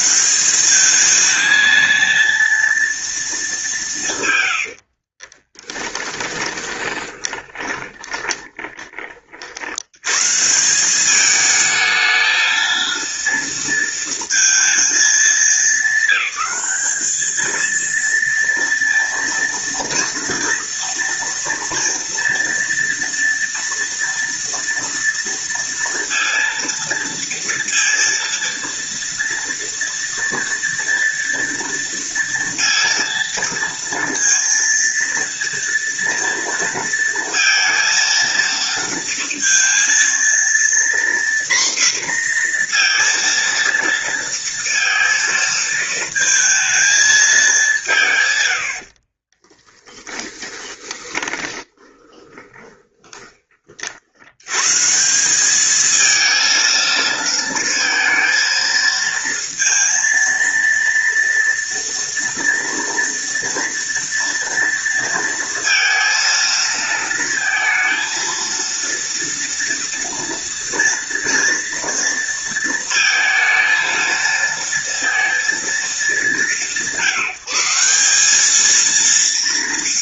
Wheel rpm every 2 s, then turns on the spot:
200, 230, 80, 20, 20, 180, 230, 220, 200, 230, 230, 230, 230, 230, 230, 230, 230, 230, 230, 230, 240, 240, 230, 220, 70, 20, 20, 130, 230, 230, 230, 230, 230, 230, 230, 230, 230, 230, 170, 220.
4-8 50-54